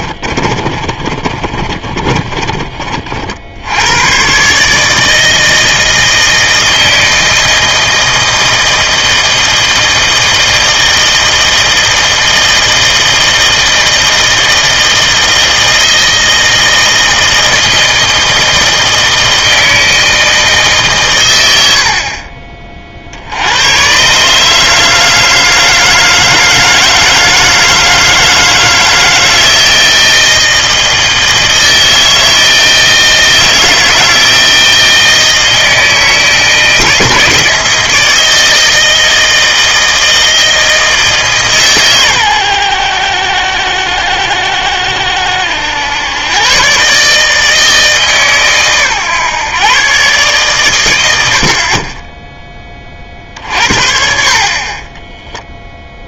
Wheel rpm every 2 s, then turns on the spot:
30, 40, 150, 160, 160, 160, 160, 160, 160, 160, 150, 40, 150, 160, 160, 160, 160, 160, 160, 160, 160, 90, 70, 130, 130, 110, 20, 30.
0-2